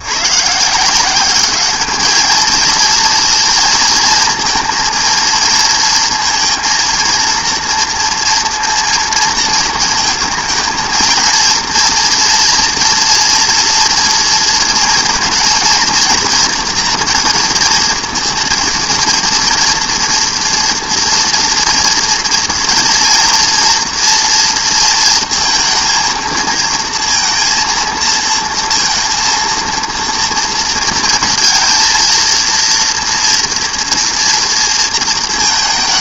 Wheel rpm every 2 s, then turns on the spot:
150, 230, 230, 230, 230, 230, 230, 230, 230, 230, 230, 230, 230, 230, 230, 230, 230, 230.
none